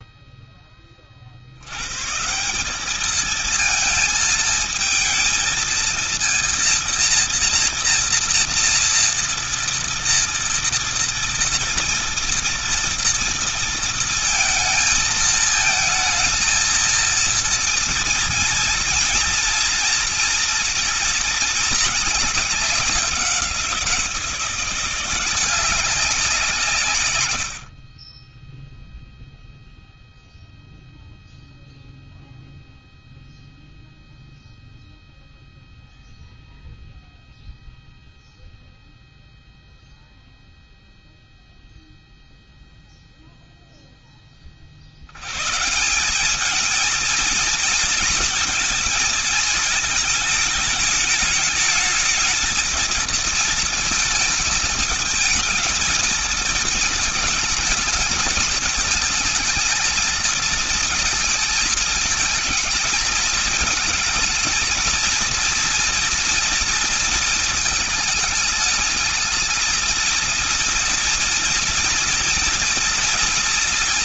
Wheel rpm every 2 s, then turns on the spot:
10, 170, 220, 230, 230, 230, 230, 220, 230, 230, 240, 200, 170, 170, 20, 0, 0, 0, 0, 0, 0, 0, 20, 200, 220, 220, 220, 220, 220, 220, 220, 220, 230, 230, 220, 230, 230.
none